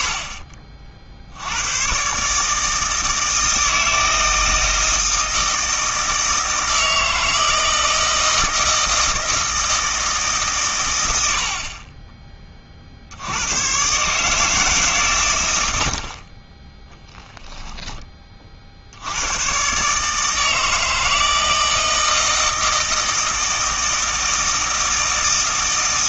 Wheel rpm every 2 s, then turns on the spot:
30, 150, 160, 160, 160, 140, 30, 150, 30, 40, 150, 160, 160.
none